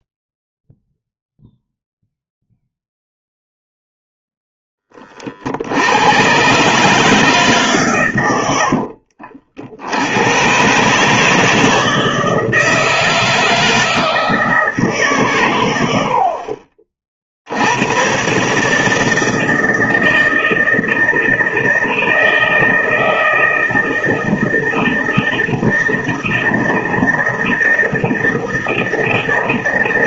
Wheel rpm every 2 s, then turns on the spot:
0, 0, 10, 140, 90, 130, 160, 160, 40, 150, 160, 160, 160, 160, 160.
8-10